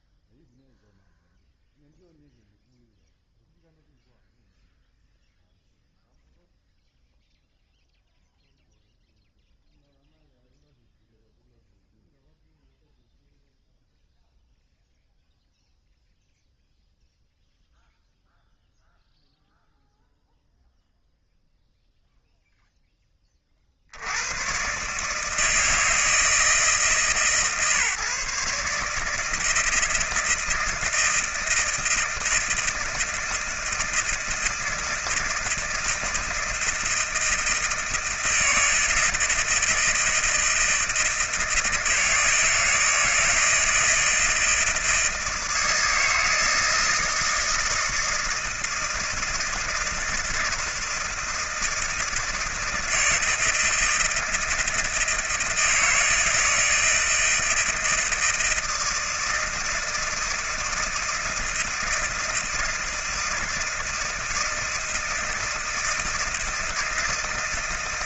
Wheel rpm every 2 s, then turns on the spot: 0, 0, 0, 0, 0, 0, 0, 0, 0, 0, 0, 0, 130, 150, 140, 160, 160, 160, 160, 160, 160, 160, 160, 160, 160, 160, 160, 160, 160, 160, 160, 160, 160, 160.
none